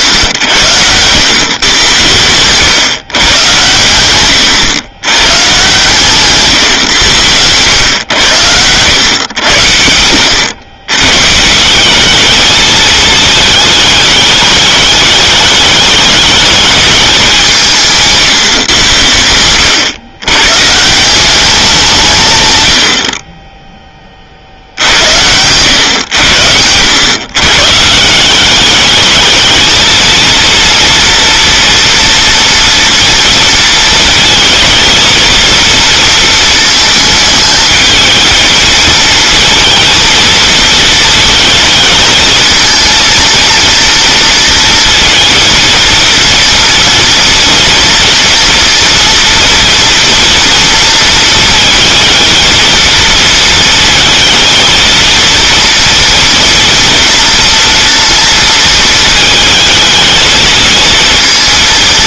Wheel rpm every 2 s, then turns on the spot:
100, 120, 110, 130, 100, 110, 220, 210, 210, 120, 130, 100, 70, 100, 200, 230, 240, 220, 220, 220, 230, 230, 230, 230, 230, 230, 220, 220, 240, 230, 230.
none